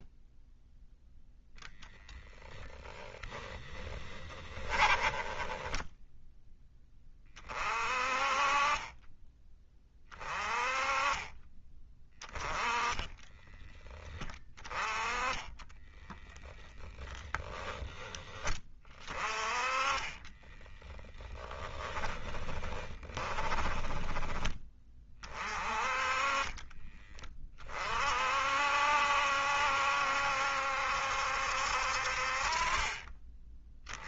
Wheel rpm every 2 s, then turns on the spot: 0, 0, 20, 20, 20, 30, 10, 20, 20, 20, 10, 20, 30, 20, 60, 70, 30.
4-6 12-18 20-24